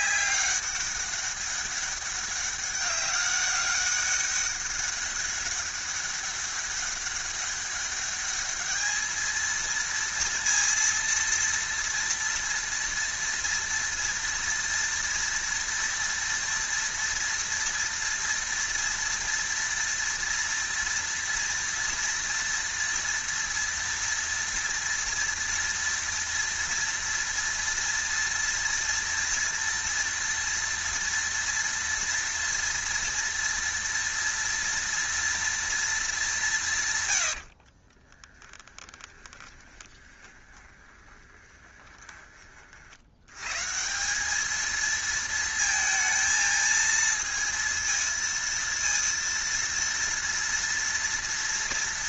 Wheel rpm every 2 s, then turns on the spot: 200, 200, 200, 200, 220, 230, 230, 230, 230, 230, 230, 230, 230, 230, 240, 240, 230, 230, 130, 20, 20, 70, 220, 230, 230, 230.
36-42